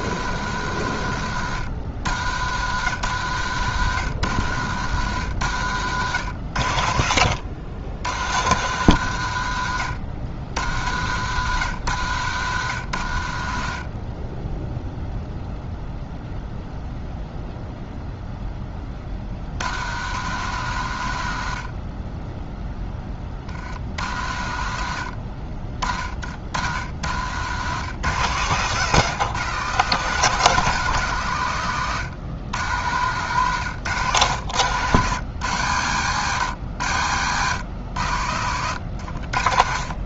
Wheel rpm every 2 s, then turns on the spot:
100, 90, 90, 70, 110, 70, 80, 0, 0, 20, 90, 10, 60, 50, 130, 160, 120, 110, 100, 90.
28-30